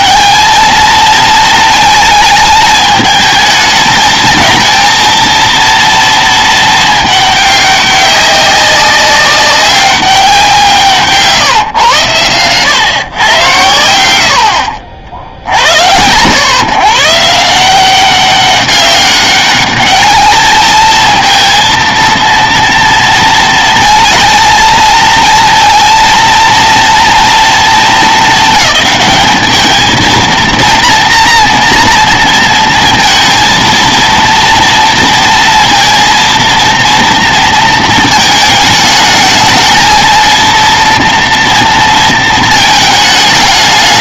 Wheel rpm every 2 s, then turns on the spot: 220, 210, 230, 220, 190, 170, 130, 70, 110, 190, 220, 230, 220, 230, 200, 230, 230, 230, 230, 220, 230, 220.
none